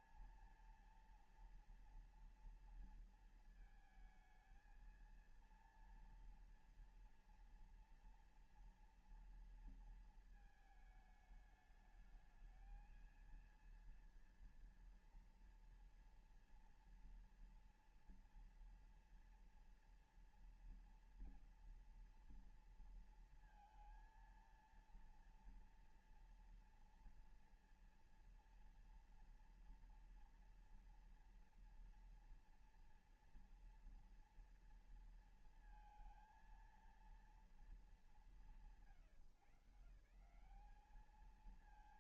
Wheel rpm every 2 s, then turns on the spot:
230, 230, 220, 230, 230, 220, 220, 230, 230, 230, 230, 230, 230, 240, 230, 230, 230, 230, 230, 180, 160.
none